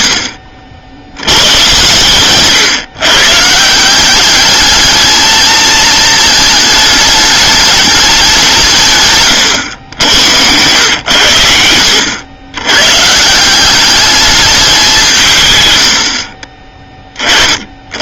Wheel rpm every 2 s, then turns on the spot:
80, 130, 210, 220, 160, 110, 120, 190, 30.
none